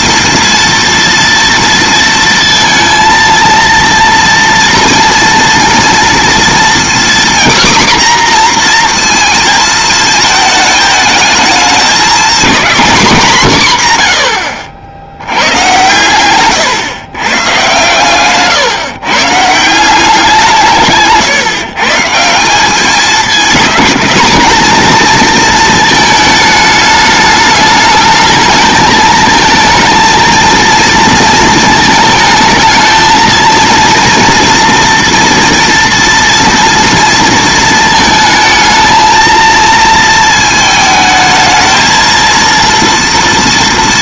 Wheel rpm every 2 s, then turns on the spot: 230, 230, 230, 250, 240, 220, 250, 80, 120, 140, 150, 200, 230, 210, 220, 230, 220, 230, 230, 220, 220, 230.
none